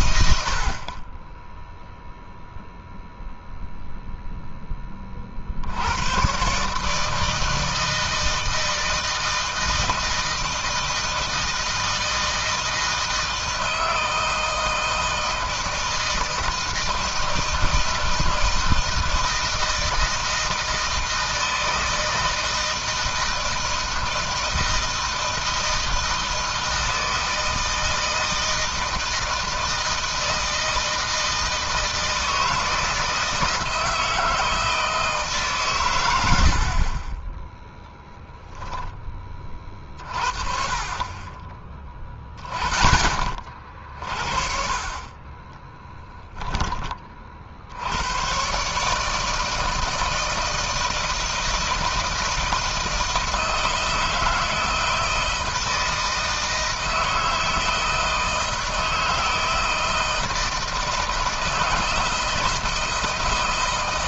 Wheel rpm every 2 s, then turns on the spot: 60, 0, 10, 120, 160, 160, 160, 160, 160, 160, 160, 160, 160, 160, 160, 160, 160, 160, 70, 0, 40, 20, 40, 20, 130, 160, 160, 160, 160, 160, 160, 160.
none